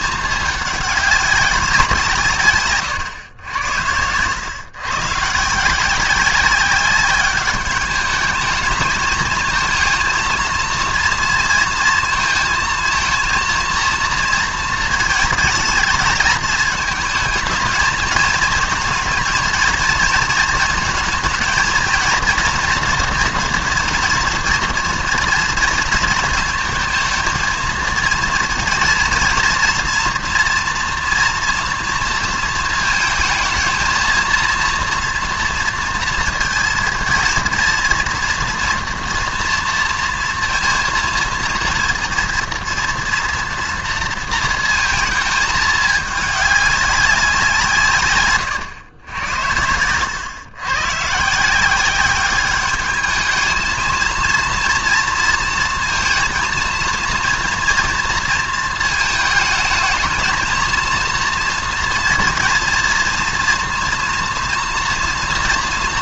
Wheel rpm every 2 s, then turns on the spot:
210, 120, 130, 200, 220, 230, 230, 230, 220, 220, 230, 230, 230, 220, 230, 240, 230, 230, 230, 230, 230, 230, 220, 200, 110, 130, 210, 230, 230, 230, 230, 230, 240.
2-4